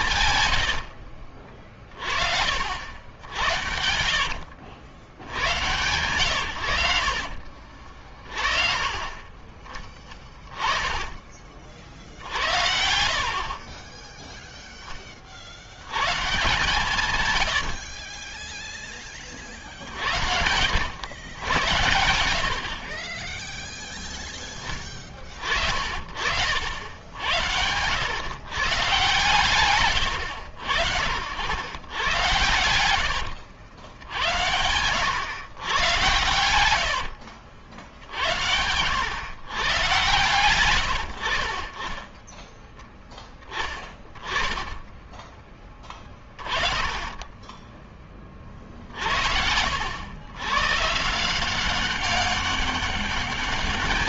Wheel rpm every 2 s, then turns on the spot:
100, 70, 80, 100, 40, 10, 50, 0, 140, 10, 80, 70, 10, 70, 130, 80, 110, 80, 90, 70, 100, 10, 20, 30, 30, 110, 200.
12-14 16-20 32-34 36-38 44-46